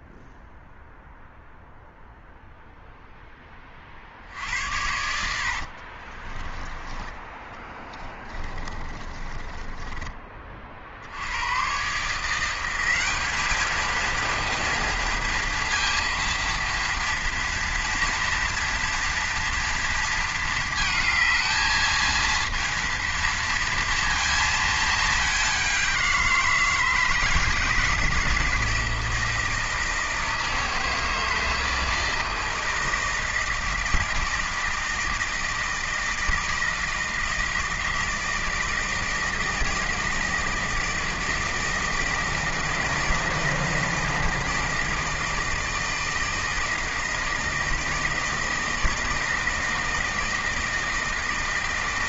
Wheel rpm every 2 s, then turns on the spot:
0, 0, 80, 20, 30, 50, 180, 230, 230, 230, 220, 230, 220, 160, 160, 160, 160, 160, 160, 160, 160, 160, 160, 160, 160, 160.
6-10